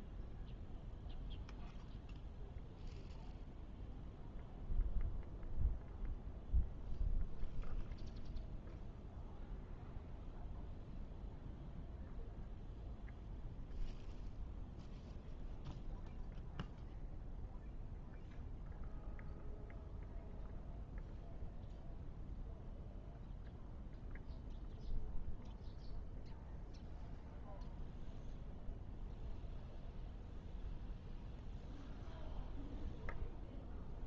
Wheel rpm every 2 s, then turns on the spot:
0, 0, 0, 0, 0, 0, 0, 0, 0, 0, 0, 0, 0, 0, 0, 0, 0.
none